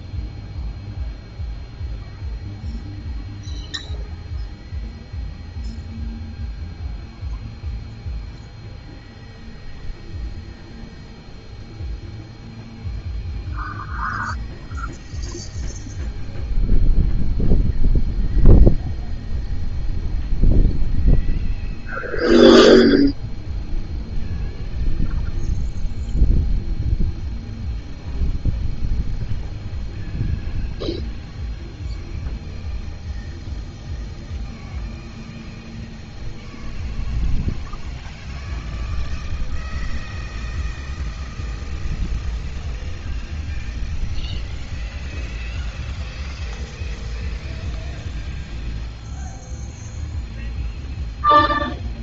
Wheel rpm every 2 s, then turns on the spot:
0, 0, 0, 0, 0, 0, 0, 0, 0, 0, 0, 0, 0, 0, 0, 0, 0, 0, 0, 0, 0, 0, 0, 0, 0, 0.
none